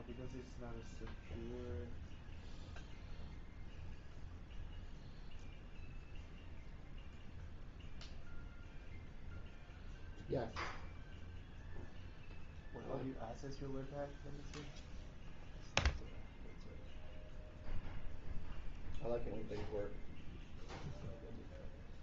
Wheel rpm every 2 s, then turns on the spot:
0, 0, 0, 0, 0, 0, 0, 0, 0, 0, 0.
none